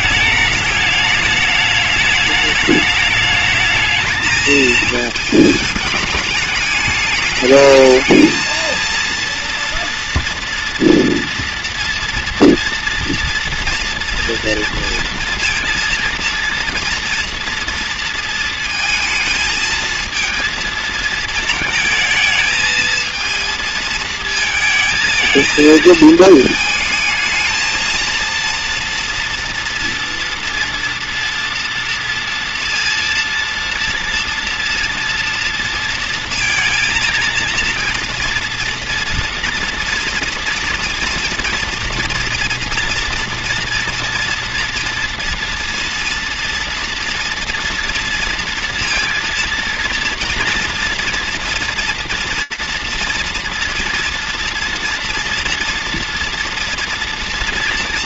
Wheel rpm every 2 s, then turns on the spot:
210, 210, 220, 210, 220, 230, 230, 230, 230, 230, 230, 220, 230, 220, 230, 230, 230, 230, 230, 230, 230, 240, 240, 230, 230, 230, 240, 240, 230.
none